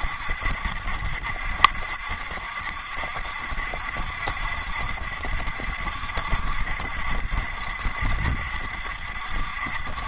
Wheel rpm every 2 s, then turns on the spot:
70, 70, 70, 70, 70.
none